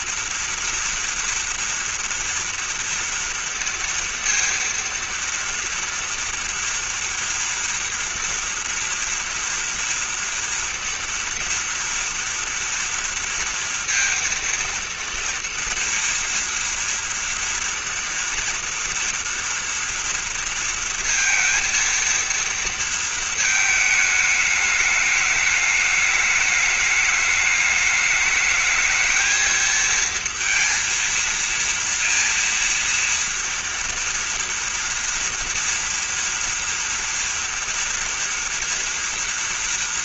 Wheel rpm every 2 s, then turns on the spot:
230, 230, 230, 230, 230, 230, 230, 230, 230, 230, 230, 230, 210, 210, 220, 230, 230, 230, 240, 230.
none